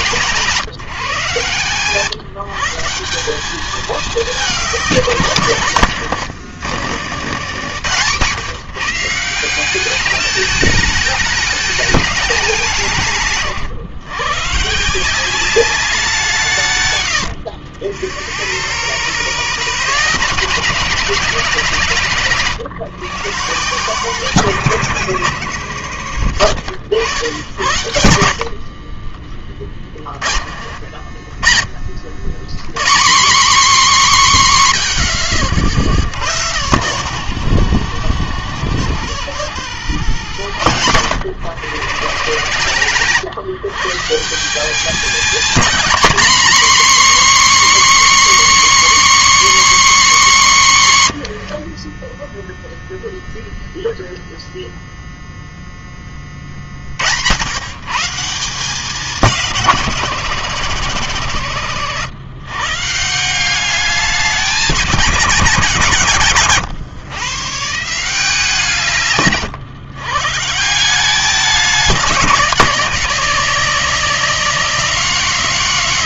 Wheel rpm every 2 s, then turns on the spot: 160, 170, 210, 90, 150, 210, 160, 150, 130, 120, 180, 140, 110, 60, 30, 50, 170, 190, 100, 70, 100, 140, 200, 270, 280, 160, 0, 0, 60, 180, 110, 140, 200, 130, 150, 170, 190, 220.
none